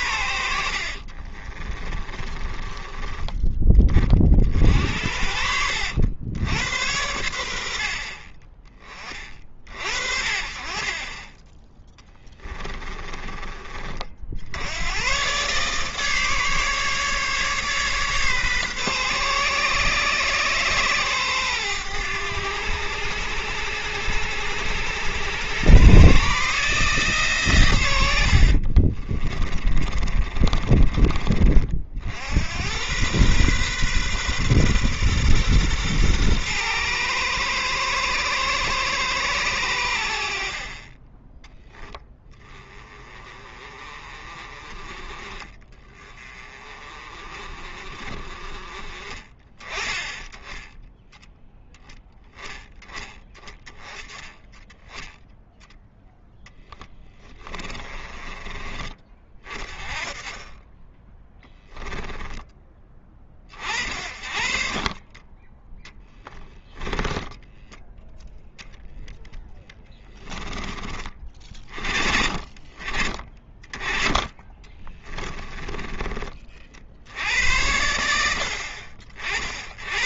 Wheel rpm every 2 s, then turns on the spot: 70, 30, 60, 90, 20, 30, 30, 90, 150, 130, 120, 100, 90, 150, 60, 30, 100, 120, 110, 110, 40, 20, 30, 30, 30, 10, 10, 10, 10, 30, 10, 10, 40, 10, 0, 20, 30, 20, 40, 70.
0-2 12-14 28-32 56-58 66-68 74-76